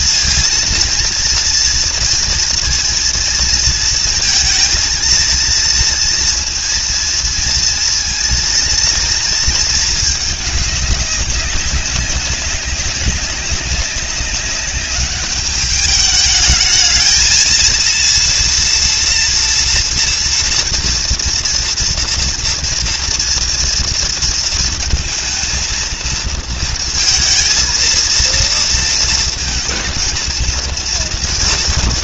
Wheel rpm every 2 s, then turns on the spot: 230, 230, 230, 230, 230, 200, 190, 210, 220, 230, 230, 230, 230, 230, 230, 230.
none